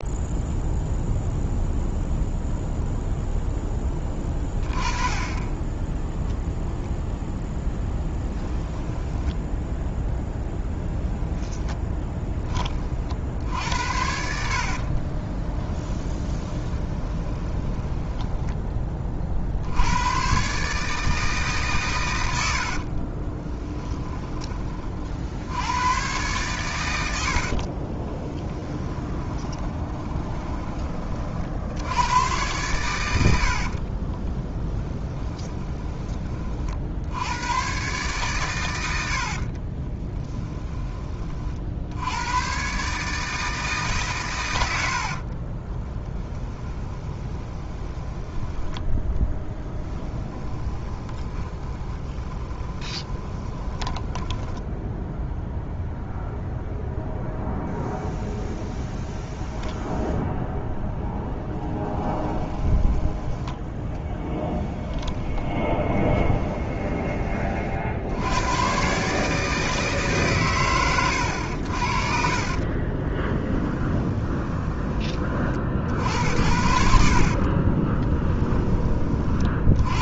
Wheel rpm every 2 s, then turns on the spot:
0, 0, 20, 0, 10, 0, 40, 30, 20, 20, 150, 40, 50, 110, 20, 30, 100, 10, 60, 80, 20, 140, 80, 20, 10, 20, 20, 0, 0, 0, 10, 20, 20, 20, 130, 110, 30, 30, 60, 30.
8-10 14-18 22-24 28-32 34-36 44-48 50-54 62-68 72-74 76-78